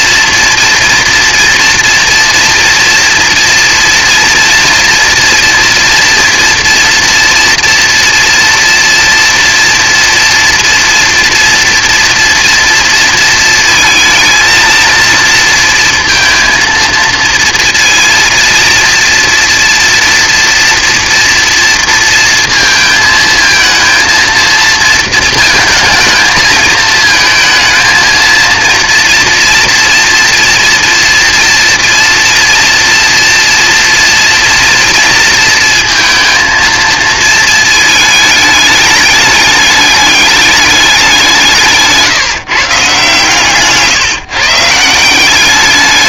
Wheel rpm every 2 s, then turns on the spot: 230, 230, 230, 230, 240, 240, 230, 230, 230, 230, 230, 230, 220, 220, 230, 230, 240, 230, 230, 210, 200, 150, 150.
none